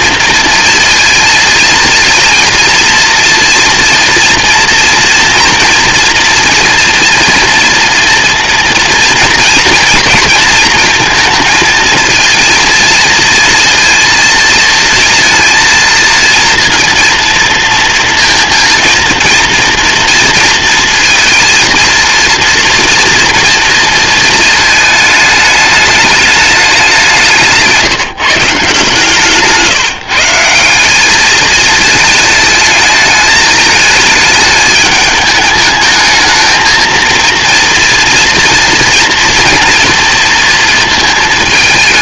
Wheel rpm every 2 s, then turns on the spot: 230, 230, 240, 240, 230, 230, 230, 230, 230, 230, 230, 230, 220, 190, 160, 190, 220, 210, 220, 230, 230.
none